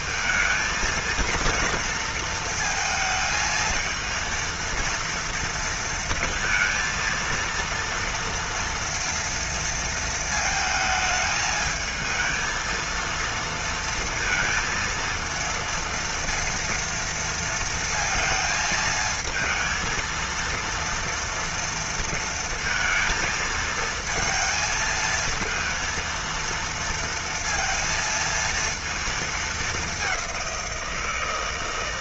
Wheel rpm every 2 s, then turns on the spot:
230, 220, 230, 230, 230, 220, 230, 230, 230, 220, 230, 220, 220, 230, 230, 180.
none